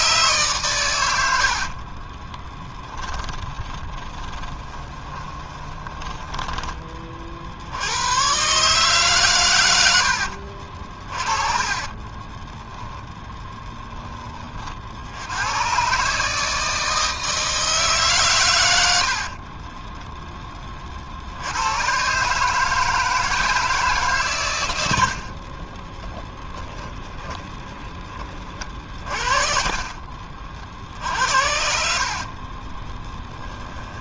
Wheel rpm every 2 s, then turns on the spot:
120, 10, 20, 20, 140, 40, 0, 60, 160, 80, 30, 160, 90, 0, 40, 60, 30.
2-6 28-34